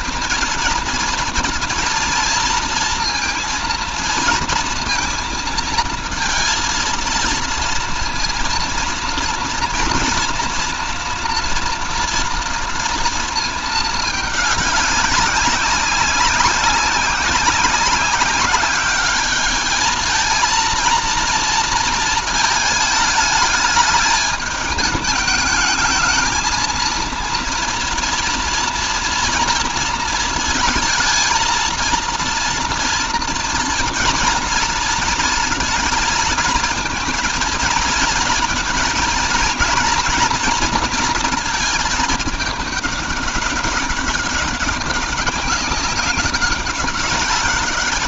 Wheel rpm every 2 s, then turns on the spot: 230, 230, 230, 230, 230, 230, 230, 200, 190, 200, 230, 220, 220, 230, 230, 220, 230, 230, 230, 230, 230, 210, 200, 190.
none